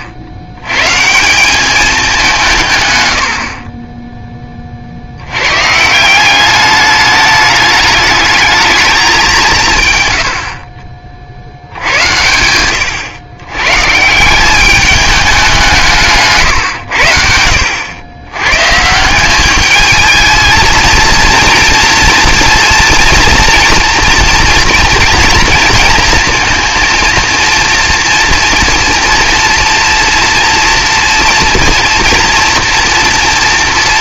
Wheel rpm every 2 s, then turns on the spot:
90, 140, 60, 210, 210, 60, 120, 200, 70, 190, 230, 230, 230, 230, 240, 230, 240.
none